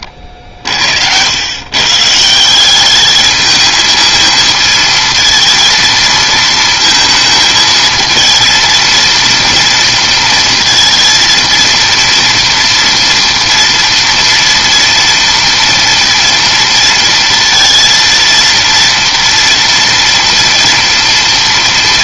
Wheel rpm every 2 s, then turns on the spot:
50, 170, 220, 230, 230, 230, 230, 230, 230, 230, 230.
none